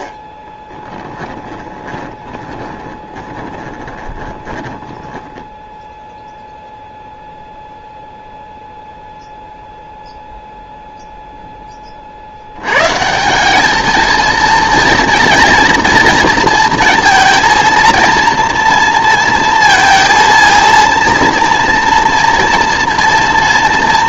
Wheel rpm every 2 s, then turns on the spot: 10, 20, 10, 0, 0, 0, 100, 220, 230, 230, 230, 230.
0-6